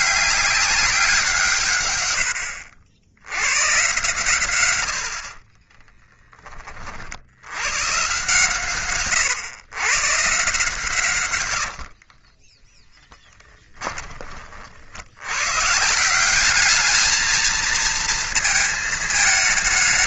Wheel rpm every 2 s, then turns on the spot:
190, 80, 70, 40, 120, 130, 10, 60, 210, 220.
12-14